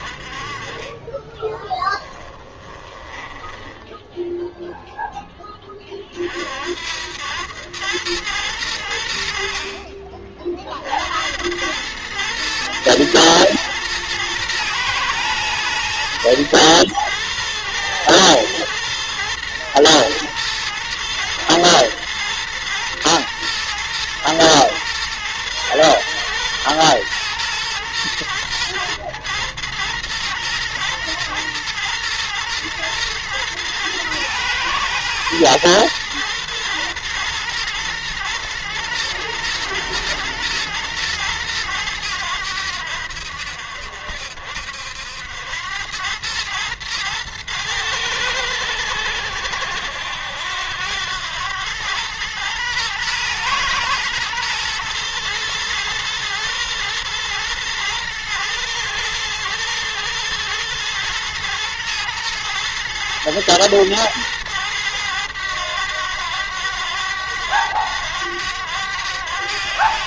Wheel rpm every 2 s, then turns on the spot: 30, 10, 0, 60, 100, 50, 110, 110, 110, 110, 110, 110, 120, 120, 120, 110, 120, 120, 110, 110, 110, 90, 70, 110, 100, 90, 110, 110, 110, 110, 110, 110, 110, 100, 90.
2-4